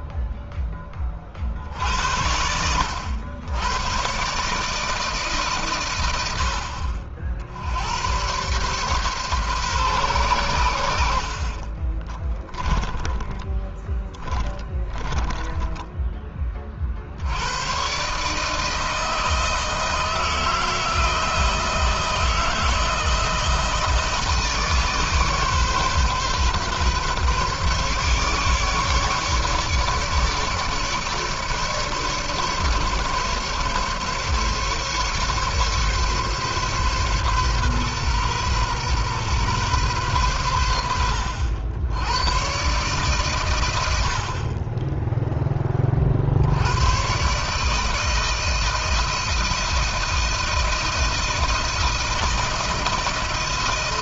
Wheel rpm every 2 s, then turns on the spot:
10, 80, 150, 70, 120, 90, 20, 20, 40, 160, 160, 160, 150, 140, 150, 150, 140, 150, 140, 120, 90, 130, 30, 100, 160, 170, 170.
12-16